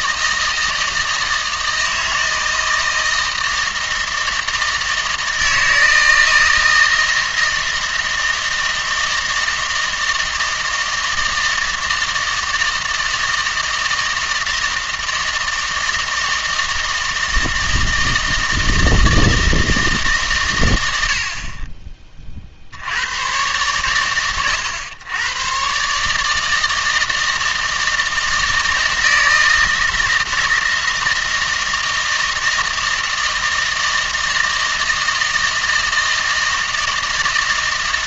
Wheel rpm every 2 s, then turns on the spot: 160, 160, 160, 160, 160, 160, 160, 160, 160, 160, 90, 60, 100, 160, 160, 160, 160, 160, 160.
none